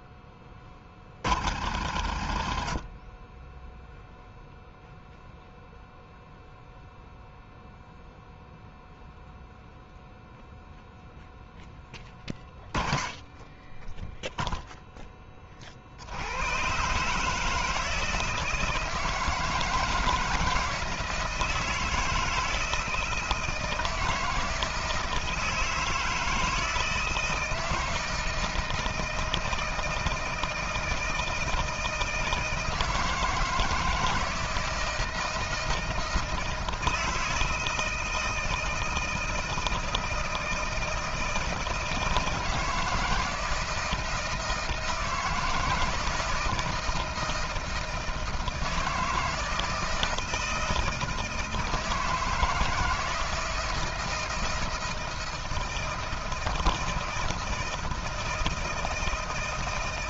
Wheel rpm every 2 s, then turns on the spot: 20, 50, 0, 0, 0, 0, 10, 0, 110, 170, 170, 160, 160, 160, 160, 160, 160, 160, 160, 160, 160, 160, 170, 160, 160, 160, 160, 160, 160, 160.
none